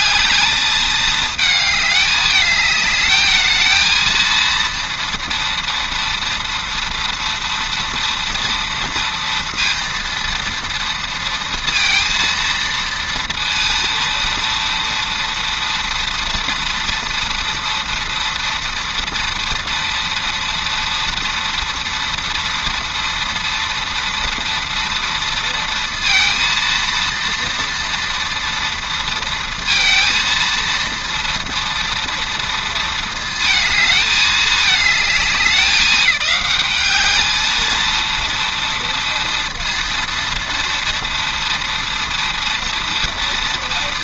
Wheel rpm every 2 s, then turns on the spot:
220, 210, 230, 230, 230, 230, 230, 230, 230, 240, 230, 230, 230, 230, 230, 230, 230, 210, 200, 230, 230, 230.
none